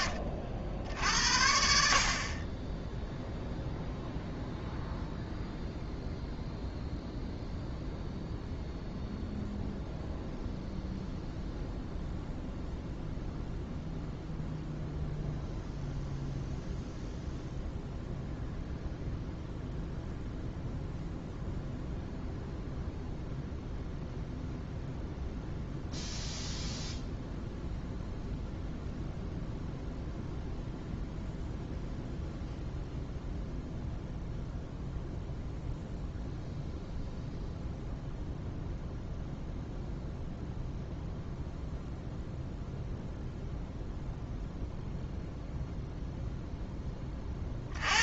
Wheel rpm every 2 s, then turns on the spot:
60, 0, 0, 0, 0, 0, 0, 0, 0, 0, 0, 0, 0, 0, 0, 0, 0, 0, 0, 0, 0, 0, 0, 10.
none